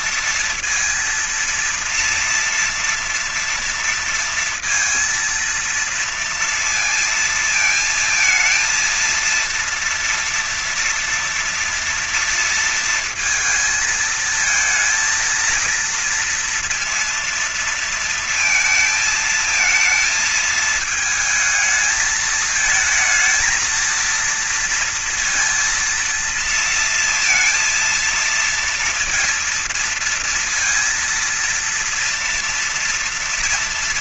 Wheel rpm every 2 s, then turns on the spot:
230, 230, 230, 230, 220, 240, 230, 230, 230, 230, 220, 220, 230, 230, 230, 230, 230.
none